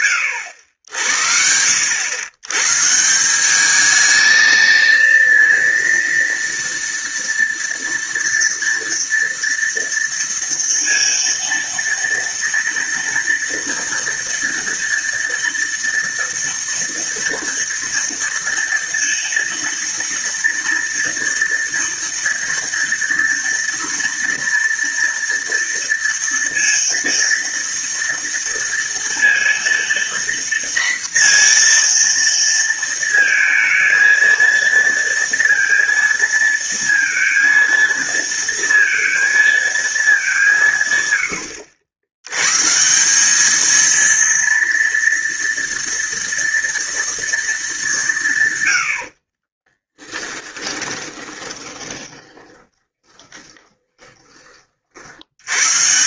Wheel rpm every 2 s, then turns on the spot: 80, 150, 230, 230, 230, 230, 230, 230, 230, 230, 230, 230, 230, 230, 230, 240, 230, 230, 230, 230, 130, 170, 230, 230, 70, 10, 10, 60.
50-54